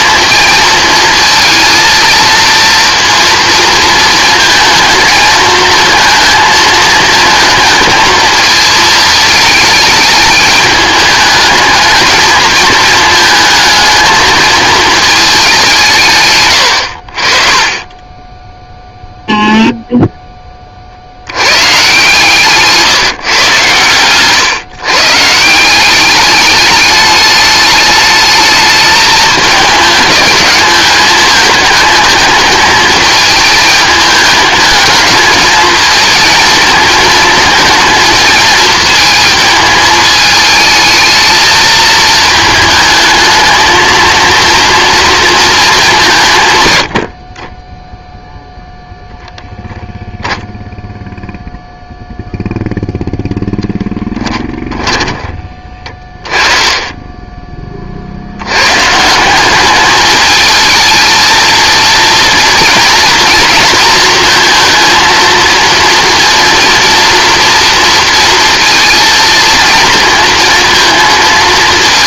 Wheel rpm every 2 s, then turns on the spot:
220, 230, 220, 220, 220, 210, 220, 220, 80, 0, 20, 150, 140, 210, 220, 210, 220, 220, 220, 220, 220, 220, 230, 110, 0, 0, 0, 20, 20, 130, 220, 230, 230, 240, 230, 230.
22-24 54-56